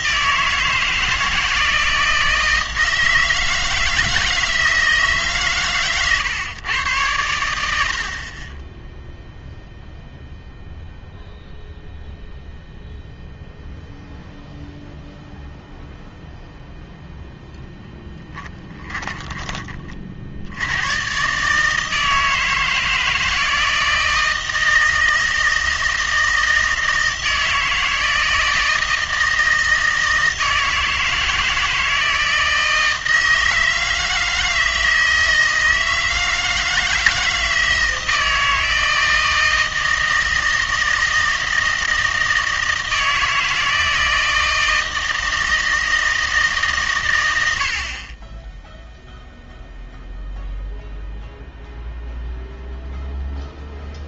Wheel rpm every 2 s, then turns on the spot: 160, 160, 160, 110, 20, 0, 0, 0, 0, 20, 90, 160, 160, 160, 160, 160, 160, 160, 160, 160, 160, 160, 160, 140, 0, 0, 0.
18-20